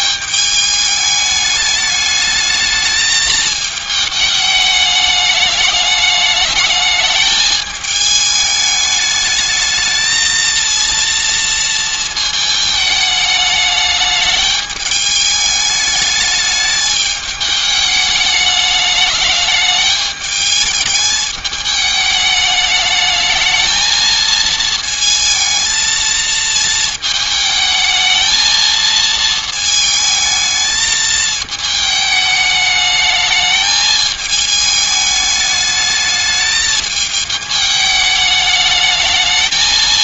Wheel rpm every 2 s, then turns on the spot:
210, 210, 210, 210, 210, 230, 210, 210, 210, 210, 210, 210, 220, 220, 220, 220, 210, 210, 210, 210.
none